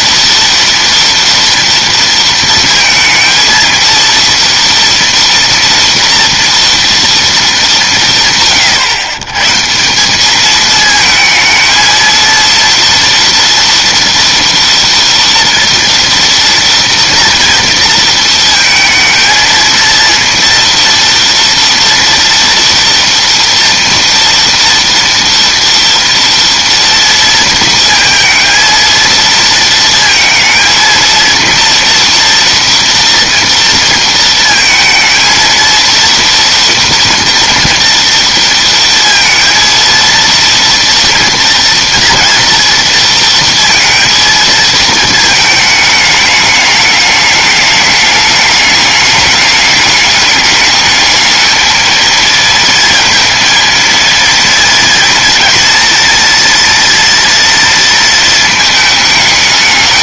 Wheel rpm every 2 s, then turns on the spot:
230, 230, 230, 230, 130, 220, 230, 230, 230, 220, 230, 230, 230, 230, 230, 230, 230, 220, 230, 230, 230, 230, 220, 210, 210, 220, 230, 230, 230, 220.
none